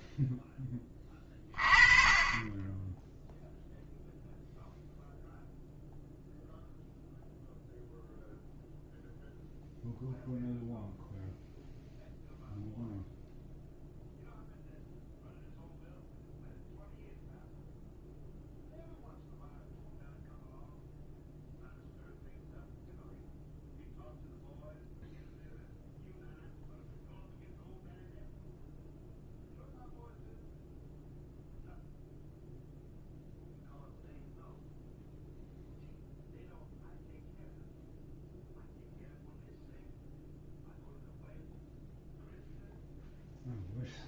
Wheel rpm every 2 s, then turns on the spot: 20, 10, 0, 0, 0, 0, 0, 0, 0, 0, 0, 0, 0, 0, 0, 0, 0, 0, 0, 0, 0, 0.
none